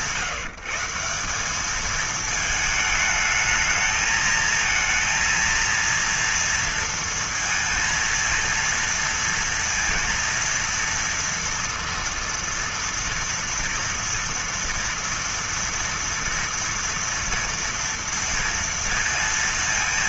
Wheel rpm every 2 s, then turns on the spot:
170, 220, 230, 230, 230, 230, 230, 230, 240, 230.
none